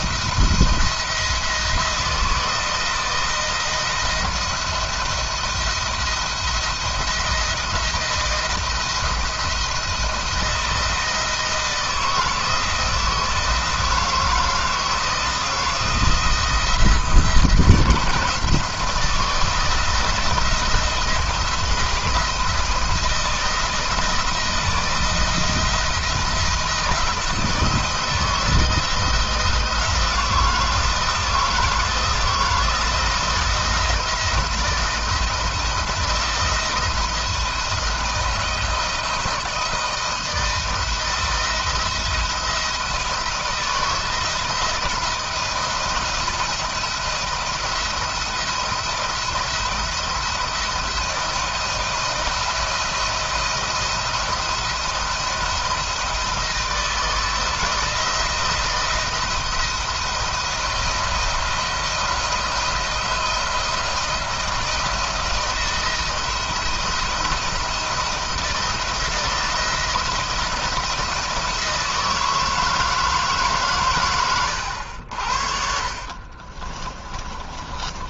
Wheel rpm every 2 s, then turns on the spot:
170, 170, 170, 160, 160, 170, 160, 160, 160, 160, 160, 170, 170, 160, 160, 170, 170, 170, 170, 160, 160, 160, 160, 170, 170, 170, 170, 170, 160, 160, 170, 170, 170, 160, 170, 170, 160, 80, 30.
76-78